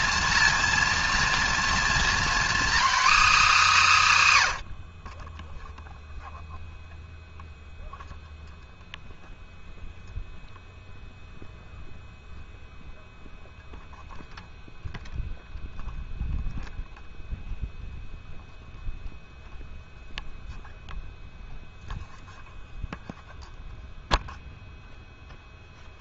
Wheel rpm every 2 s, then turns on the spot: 230, 270, 130, 0, 0, 0, 0, 0, 0, 0, 0, 0, 0.
none